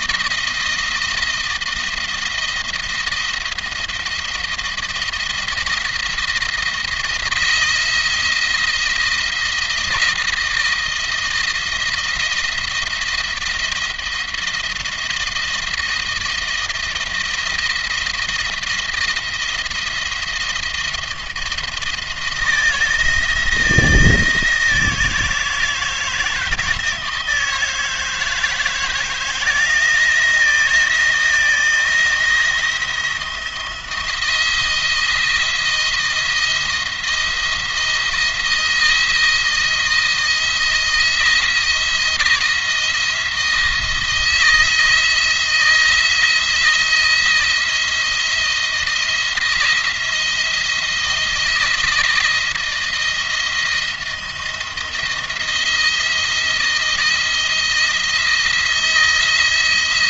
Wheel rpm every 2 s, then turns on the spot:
160, 170, 170, 170, 160, 160, 170, 160, 160, 170, 170, 170, 160, 160, 160, 160, 170, 170, 170, 170, 160, 160, 170, 160, 170, 170, 170, 170, 170, 170.
none